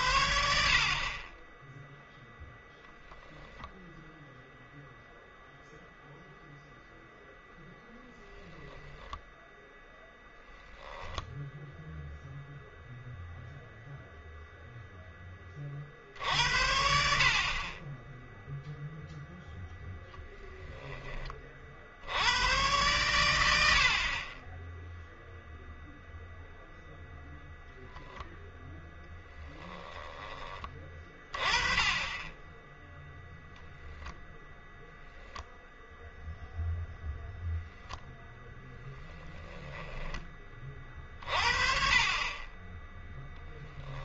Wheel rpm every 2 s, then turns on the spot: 60, 0, 0, 0, 10, 0, 0, 0, 70, 0, 10, 110, 10, 0, 10, 20, 10, 10, 0, 20, 30, 10.
38-40